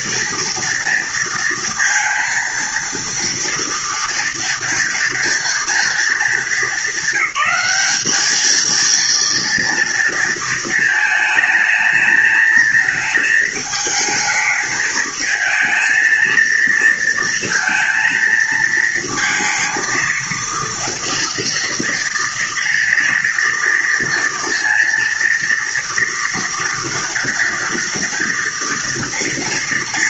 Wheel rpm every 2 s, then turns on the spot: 230, 230, 230, 200, 220, 230, 220, 220, 220, 230, 230, 230, 230, 230, 230.
none